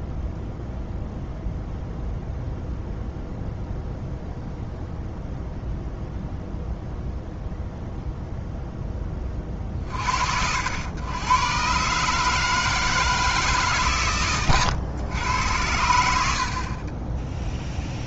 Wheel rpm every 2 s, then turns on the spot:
0, 0, 0, 0, 10, 90, 160, 110, 30.
none